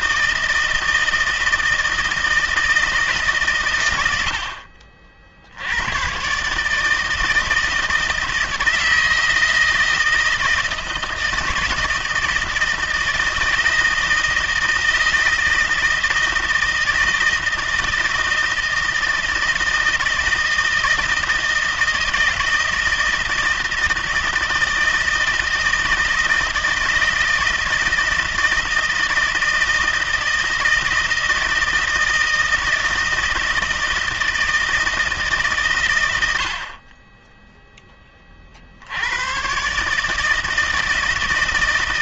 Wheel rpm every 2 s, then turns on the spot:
160, 160, 70, 140, 160, 160, 160, 160, 160, 160, 160, 160, 160, 160, 160, 160, 160, 160, 70, 50, 160.
none